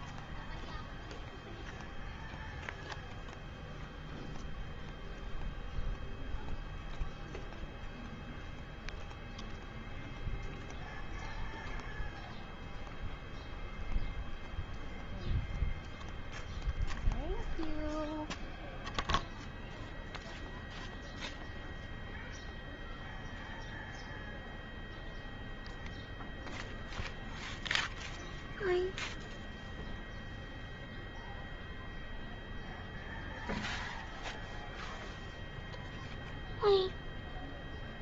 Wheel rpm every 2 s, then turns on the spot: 0, 0, 0, 0, 0, 0, 0, 0, 0, 0, 0, 0, 0, 0, 0, 0, 0, 0, 0.
none